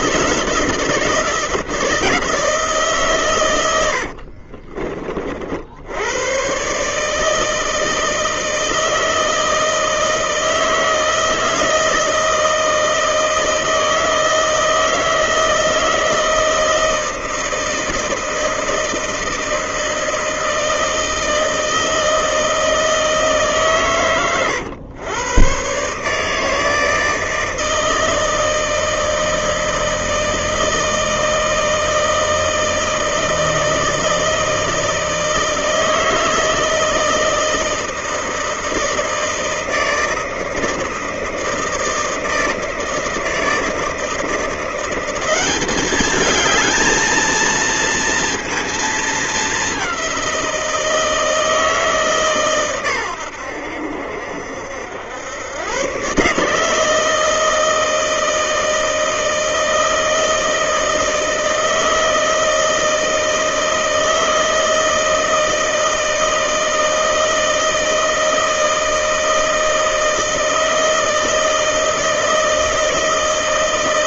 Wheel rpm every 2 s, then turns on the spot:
160, 150, 50, 140, 160, 160, 160, 160, 160, 160, 160, 160, 110, 160, 160, 160, 160, 160, 160, 160, 160, 160, 170, 220, 230, 170, 120, 80, 150, 160, 160, 160, 160, 160, 160, 160, 160.
none